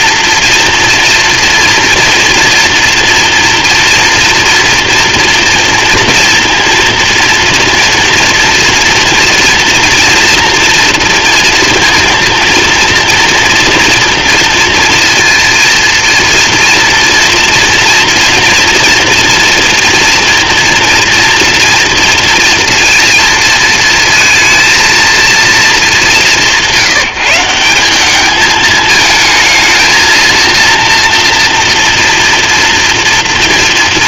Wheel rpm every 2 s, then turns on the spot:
230, 230, 230, 230, 230, 230, 230, 230, 230, 240, 230, 230, 230, 180, 220, 240, 230.
none